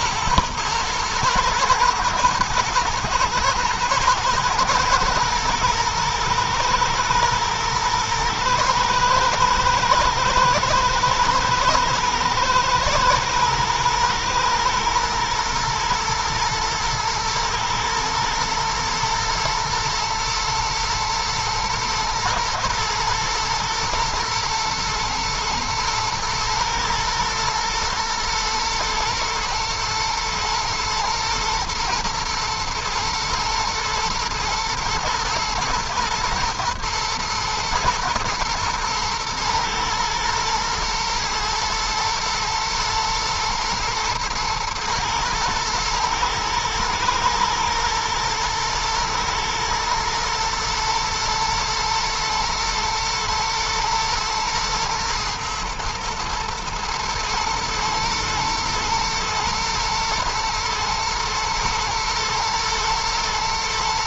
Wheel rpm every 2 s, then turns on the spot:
110, 110, 120, 120, 110, 110, 110, 120, 110, 110, 110, 110, 110, 110, 110, 120, 120, 120, 120, 120, 110, 120, 110, 120, 120, 120, 110, 110, 110, 120, 120, 120.
none